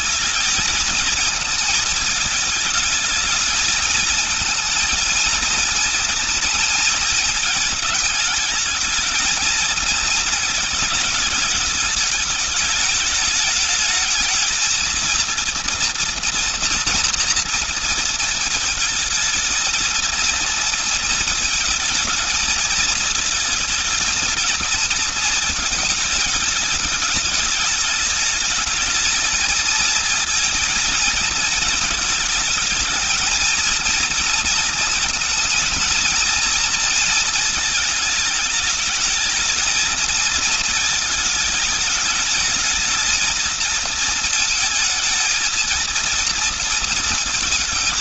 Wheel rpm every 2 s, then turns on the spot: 220, 220, 230, 230, 220, 220, 210, 220, 230, 220, 230, 220, 230, 210, 220, 220, 220, 230, 230, 220, 220, 220, 220, 230.
none